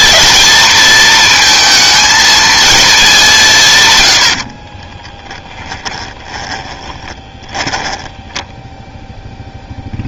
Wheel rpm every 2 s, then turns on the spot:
230, 220, 30, 20, 0.
4-8